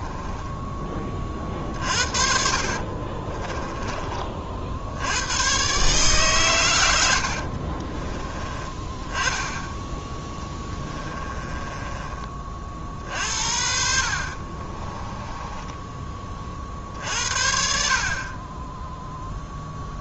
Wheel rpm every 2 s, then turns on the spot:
10, 50, 60, 110, 20, 10, 50, 30, 40, 20.
2-4 10-12 14-16